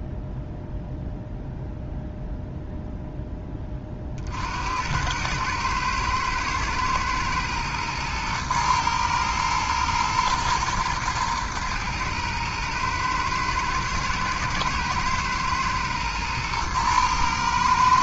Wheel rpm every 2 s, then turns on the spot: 0, 0, 70, 110, 110, 110, 110, 110, 110.
none